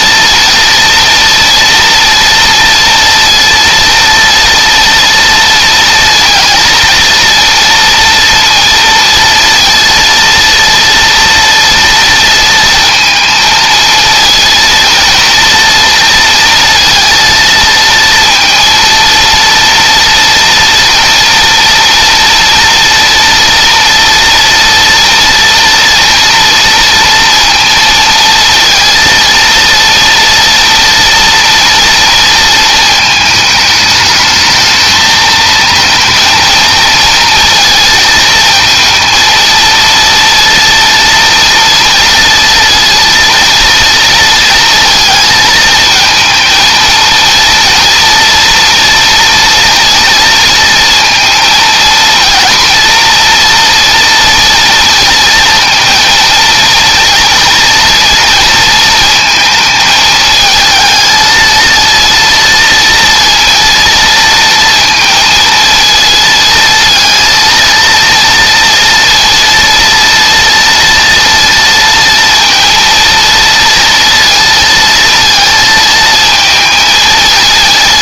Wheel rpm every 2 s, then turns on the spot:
230, 230, 230, 230, 230, 230, 230, 230, 230, 230, 230, 230, 230, 230, 230, 230, 220, 220, 230, 230, 230, 230, 220, 230, 230, 230, 230, 230, 230, 230, 220, 230, 230, 230, 230, 230, 230, 230, 220.
none